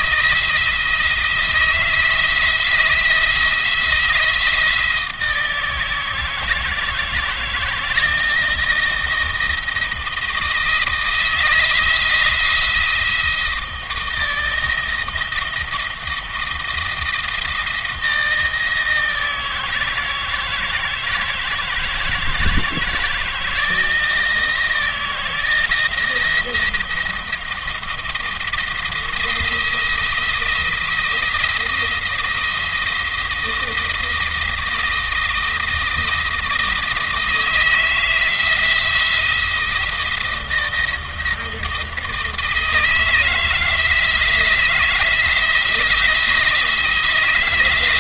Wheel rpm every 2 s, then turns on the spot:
170, 160, 160, 160, 160, 160, 170, 160, 160, 160, 160, 160, 170, 170, 170, 170, 170, 160, 160, 170, 170, 160, 170, 160.
none